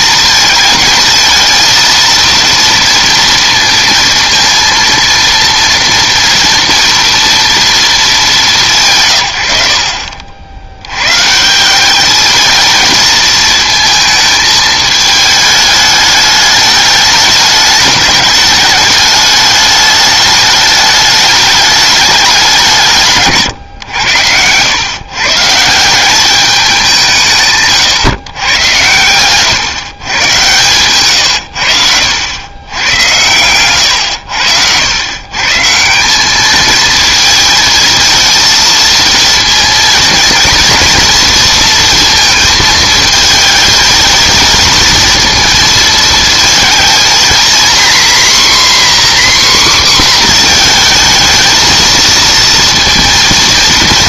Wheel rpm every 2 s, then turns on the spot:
230, 230, 230, 230, 170, 90, 220, 220, 210, 210, 210, 160, 110, 190, 110, 120, 100, 90, 220, 220, 230, 220, 230, 220, 270, 240, 230.
none